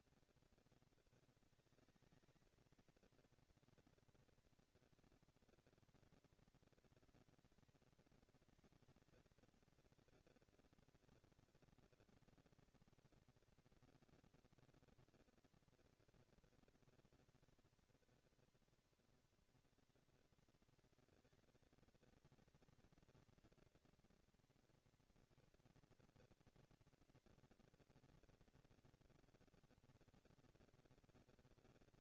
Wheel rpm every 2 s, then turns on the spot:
230, 230, 230, 230, 230, 230, 230, 230, 240, 230, 230, 240, 230, 230, 230, 230.
none